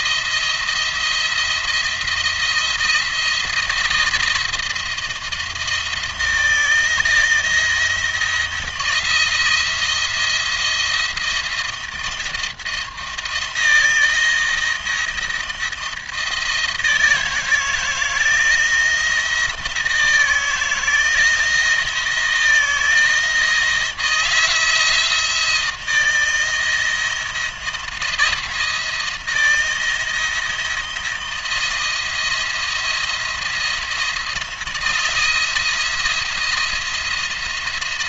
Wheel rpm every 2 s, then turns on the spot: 170, 170, 170, 160, 170, 170, 170, 160, 160, 160, 160, 160, 160, 170, 170, 170, 170, 170, 170.
none